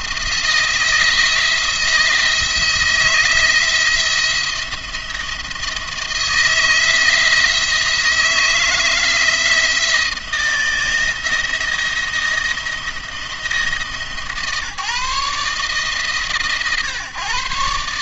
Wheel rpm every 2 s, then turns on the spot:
160, 160, 170, 160, 170, 170, 170, 160, 140.
none